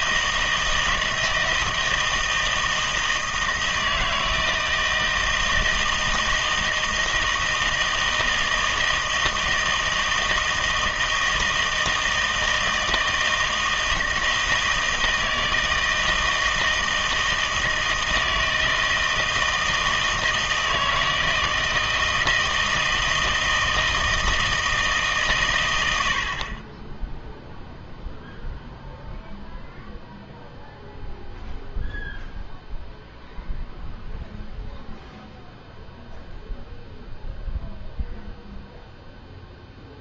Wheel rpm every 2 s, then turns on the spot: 160, 160, 160, 160, 160, 160, 160, 160, 160, 160, 160, 160, 160, 30, 0, 0, 0, 0, 0, 0.
none